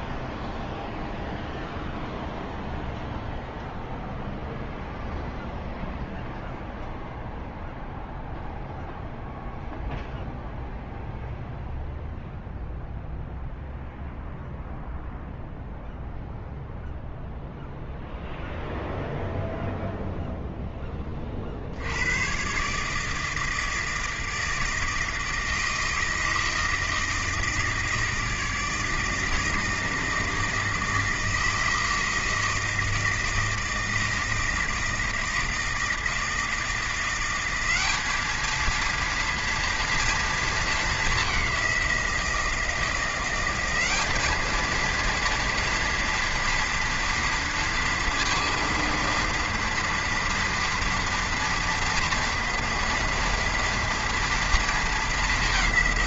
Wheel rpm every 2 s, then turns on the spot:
0, 0, 0, 0, 0, 0, 0, 0, 0, 0, 10, 130, 160, 160, 160, 160, 160, 160, 170, 220, 220, 170, 220, 230, 230, 230, 230, 230.
none